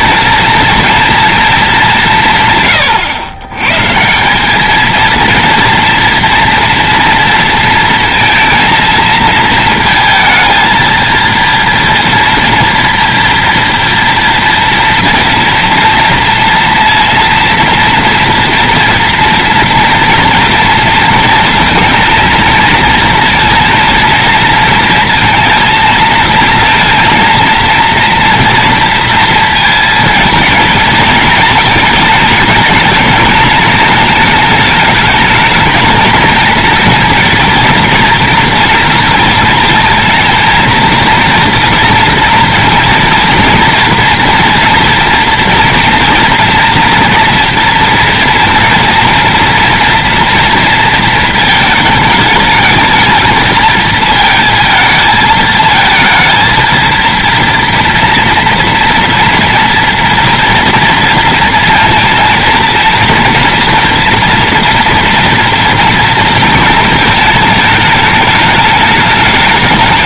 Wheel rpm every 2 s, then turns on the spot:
230, 120, 230, 230, 230, 230, 230, 230, 230, 230, 230, 230, 230, 220, 230, 230, 220, 220, 230, 230, 230, 230, 230, 230, 230, 220, 220, 220, 230, 230, 230, 230, 230, 220, 210.
none